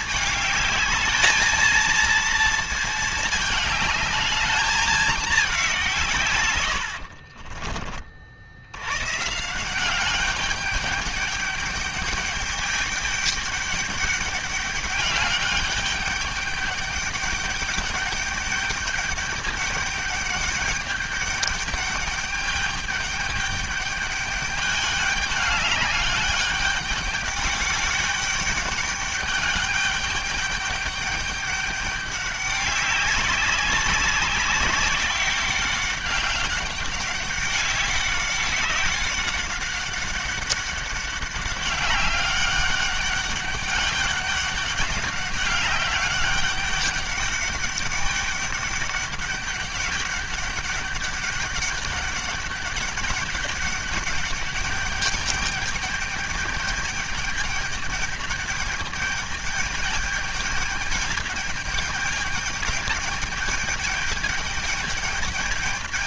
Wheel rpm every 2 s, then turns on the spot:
210, 230, 210, 110, 80, 200, 210, 200, 200, 210, 200, 210, 210, 200, 200, 200, 200, 200, 200, 190, 200, 200, 200, 200, 200, 200, 200, 200, 210, 210, 210, 210, 210.
6-8